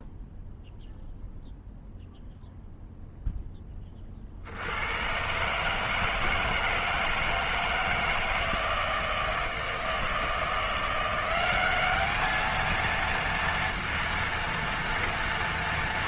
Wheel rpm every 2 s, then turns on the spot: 0, 0, 80, 160, 160, 170, 220, 230.
none